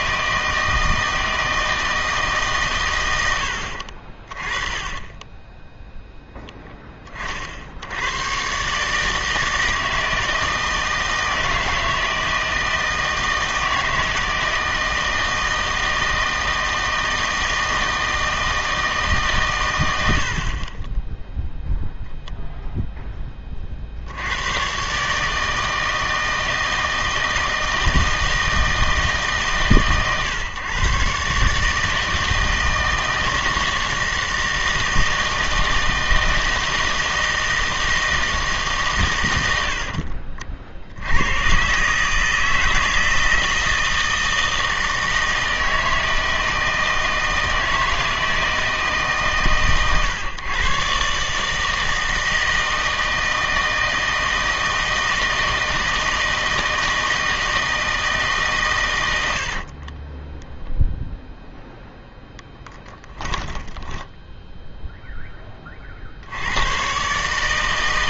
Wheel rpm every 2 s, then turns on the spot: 160, 130, 20, 10, 140, 160, 160, 160, 160, 160, 30, 0, 120, 160, 160, 130, 160, 160, 160, 150, 50, 160, 160, 160, 160, 130, 160, 160, 160, 120, 0, 10, 0, 100.
4-6 62-64